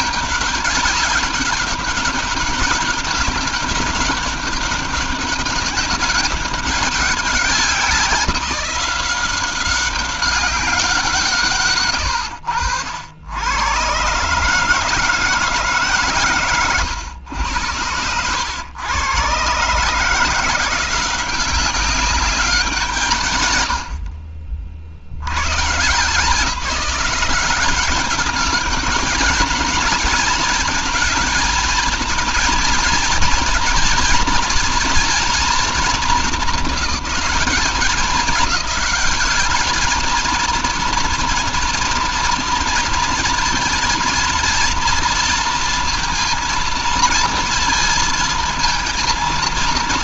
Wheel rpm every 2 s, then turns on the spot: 200, 200, 200, 200, 180, 190, 90, 150, 130, 100, 180, 180, 60, 180, 200, 220, 230, 230, 200, 200, 230, 230, 230, 220, 230.
none